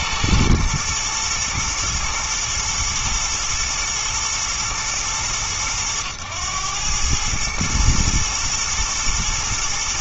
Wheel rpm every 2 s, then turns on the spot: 110, 110, 110, 100, 110.
none